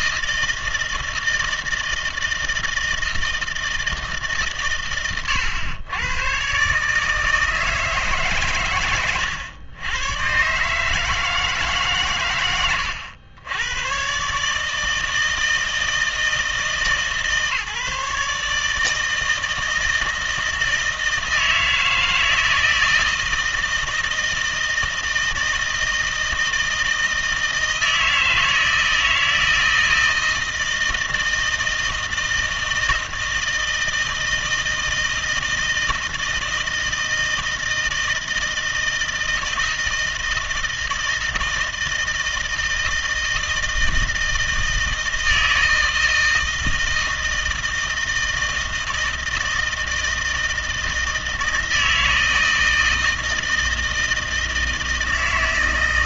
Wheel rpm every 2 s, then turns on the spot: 160, 160, 130, 140, 120, 140, 100, 150, 160, 150, 160, 160, 160, 160, 160, 160, 160, 160, 160, 160, 160, 160, 160, 160, 160, 160, 160, 160.
none